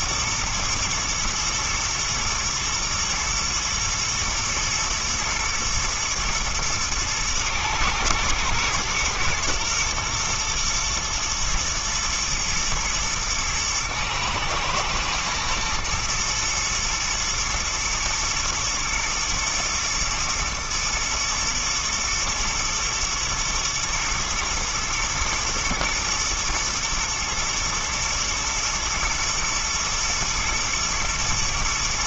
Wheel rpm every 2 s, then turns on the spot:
120, 110, 110, 120, 120, 120, 120, 110, 110, 120, 110, 120, 110, 120, 110, 120.
none